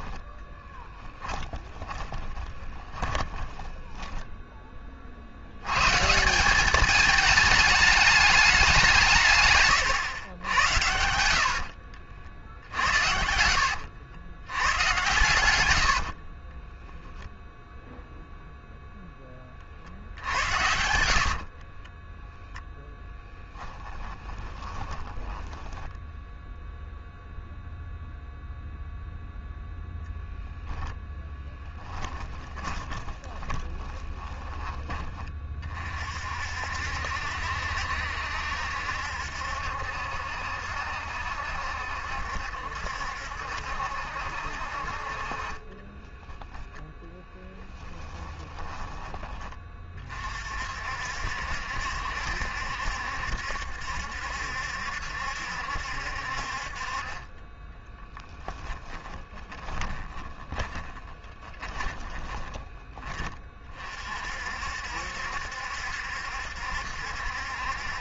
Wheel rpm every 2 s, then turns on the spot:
10, 20, 20, 200, 190, 90, 60, 90, 10, 0, 70, 0, 20, 0, 0, 0, 20, 30, 60, 70, 70, 70, 50, 10, 20, 50, 70, 70, 40, 10, 10, 20, 60, 70.
0-4 12-14 16-18 20-22 24-26 32-34 46-50 58-62